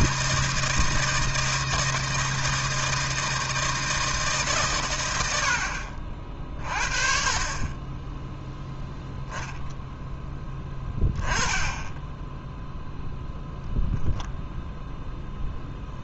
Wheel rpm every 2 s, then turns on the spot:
160, 160, 110, 50, 0, 10, 0, 0.
none